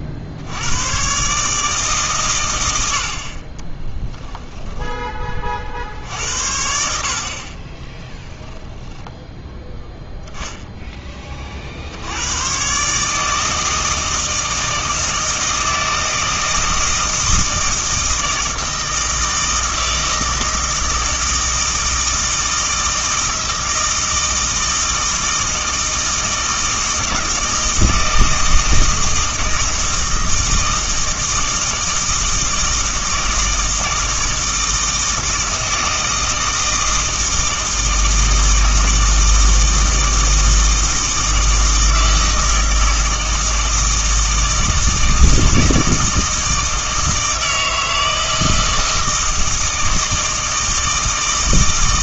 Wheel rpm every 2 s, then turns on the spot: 100, 90, 10, 70, 10, 10, 130, 160, 160, 160, 160, 160, 160, 160, 160, 160, 160, 160, 160, 160, 160, 160, 160, 160, 160, 160.
4-6